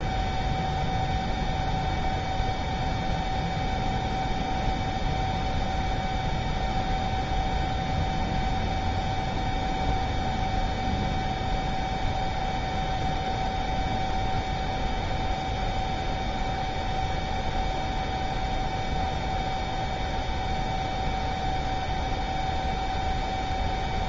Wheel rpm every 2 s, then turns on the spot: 0, 0, 0, 0, 0, 0, 0, 0, 0, 0, 0, 0.
none